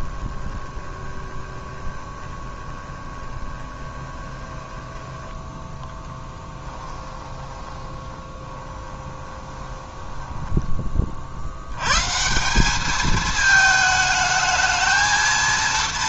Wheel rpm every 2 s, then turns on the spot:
20, 20, 10, 20, 20, 30, 200, 220.
0-10